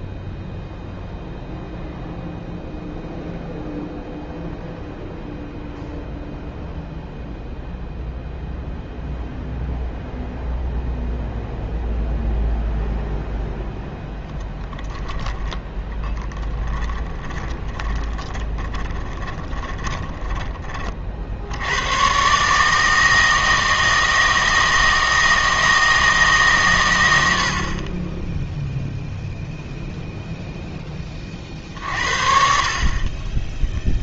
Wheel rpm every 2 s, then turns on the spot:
0, 0, 0, 0, 0, 0, 0, 10, 10, 20, 30, 150, 160, 130, 0, 10, 40.
16-20